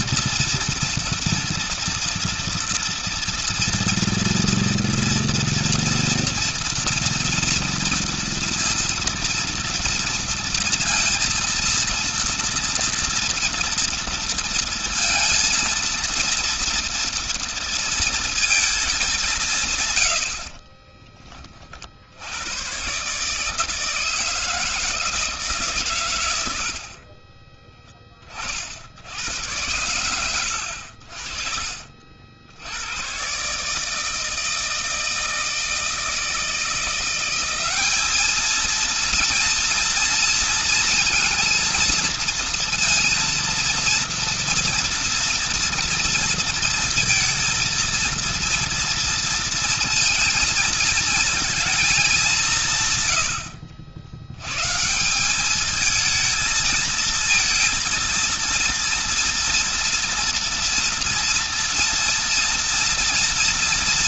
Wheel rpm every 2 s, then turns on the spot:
230, 230, 230, 230, 230, 230, 230, 230, 230, 230, 80, 80, 160, 120, 40, 100, 90, 160, 160, 220, 230, 230, 230, 230, 230, 230, 180, 120, 230, 230, 230, 230.
none